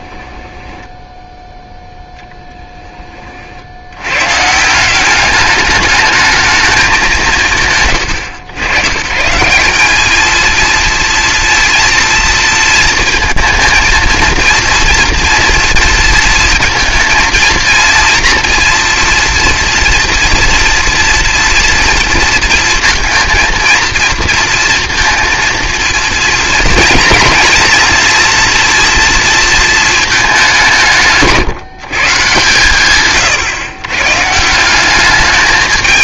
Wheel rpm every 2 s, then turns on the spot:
10, 10, 160, 210, 120, 230, 230, 230, 230, 230, 230, 230, 230, 230, 240, 180, 120, 180.
0-2